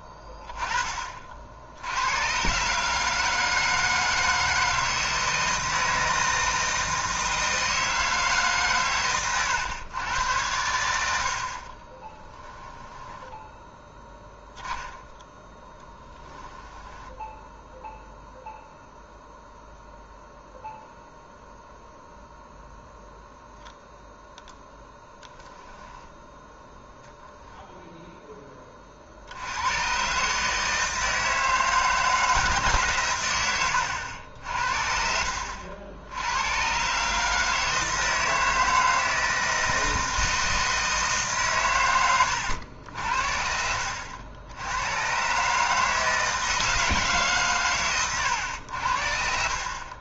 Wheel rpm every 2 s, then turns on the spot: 20, 140, 160, 160, 130, 90, 10, 10, 10, 0, 0, 0, 0, 0, 30, 150, 140, 60, 120, 160, 160, 80, 100, 160, 70.
12-14 16-18